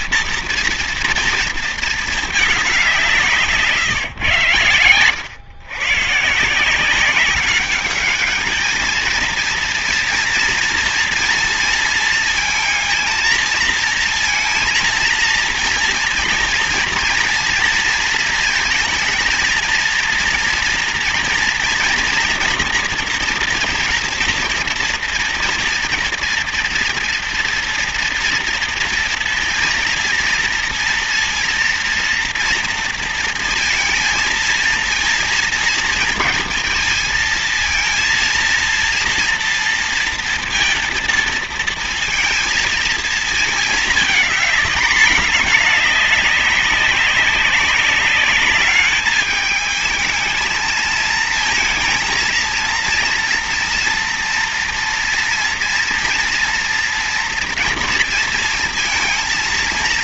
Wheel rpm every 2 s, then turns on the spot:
230, 190, 120, 170, 220, 230, 230, 230, 230, 230, 230, 230, 230, 230, 230, 230, 240, 230, 220, 230, 230, 230, 220, 200, 200, 220, 230, 240, 240, 230.
none